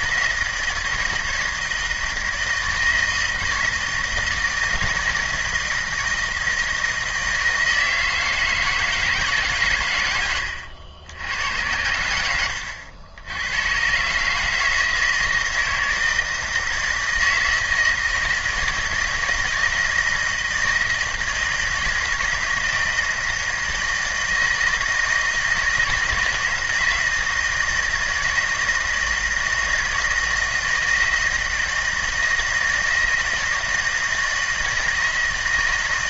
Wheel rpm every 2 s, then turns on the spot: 160, 160, 160, 160, 160, 90, 90, 160, 160, 160, 160, 160, 160, 160, 160, 170, 160, 160.
none